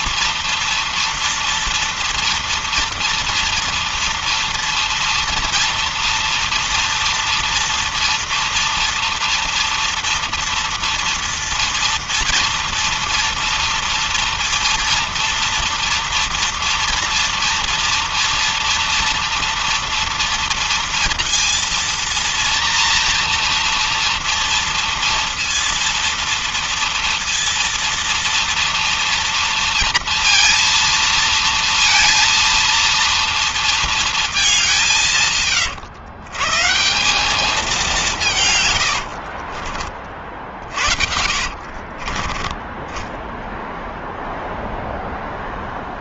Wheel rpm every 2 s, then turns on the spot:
230, 230, 230, 230, 230, 230, 230, 230, 230, 230, 230, 230, 230, 230, 230, 230, 230, 170, 180, 80, 50, 10, 10.
38-42